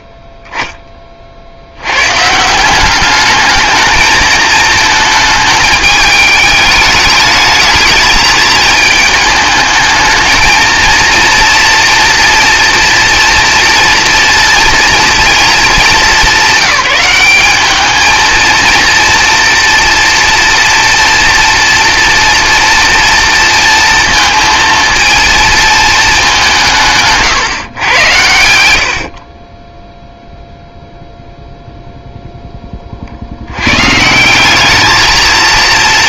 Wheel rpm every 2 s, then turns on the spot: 20, 180, 220, 210, 220, 230, 240, 230, 190, 230, 230, 230, 230, 180, 80, 0, 20, 200.
none